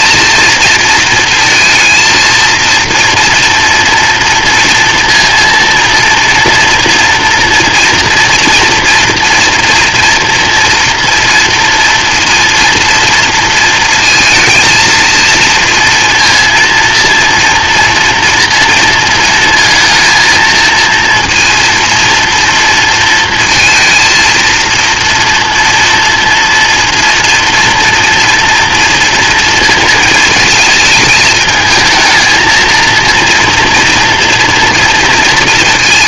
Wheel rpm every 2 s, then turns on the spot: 230, 230, 230, 230, 230, 230, 230, 230, 230, 230, 230, 230, 230, 230, 230, 220, 230, 230.
none